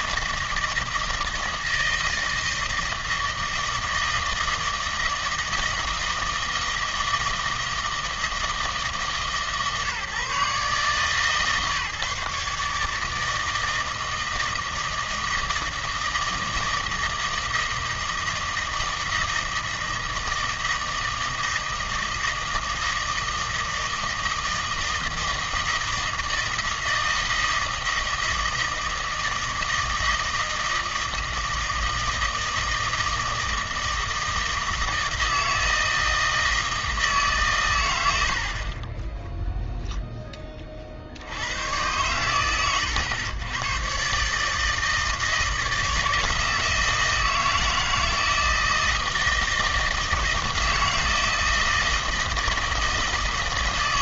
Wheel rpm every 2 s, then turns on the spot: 160, 160, 160, 160, 160, 140, 150, 160, 160, 160, 160, 160, 160, 160, 160, 160, 160, 160, 160, 40, 30, 110, 150, 160, 160, 160, 160.
none